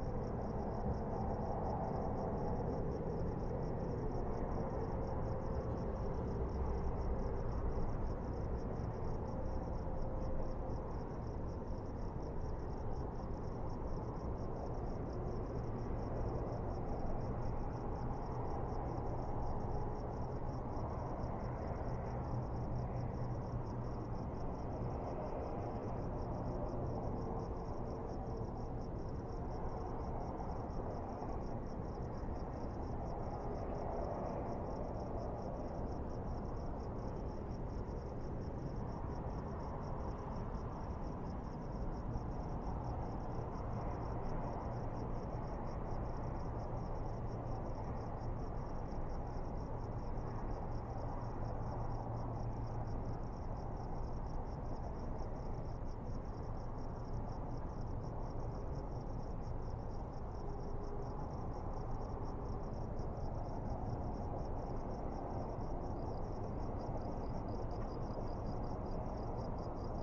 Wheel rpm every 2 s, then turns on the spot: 0, 0, 0, 0, 0, 0, 0, 0, 0, 0, 0, 0, 0, 0, 0, 0, 0, 0, 0, 0, 0, 0, 0, 0, 0, 0, 0, 0, 0, 0, 0, 0, 0, 0, 0.
none